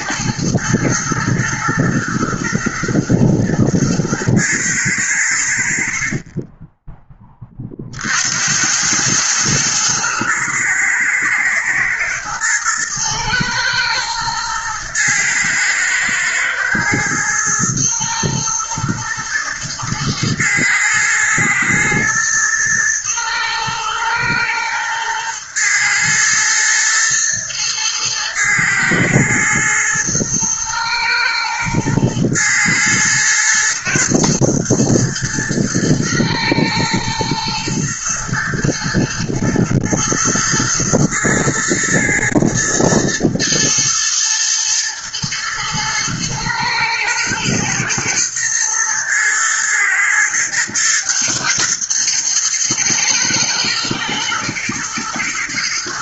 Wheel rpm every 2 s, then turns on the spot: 110, 110, 100, 10, 100, 110, 110, 110, 110, 110, 110, 110, 110, 110, 110, 110, 110, 120, 110, 120, 120, 110, 110, 110, 120, 110, 110, 110.
none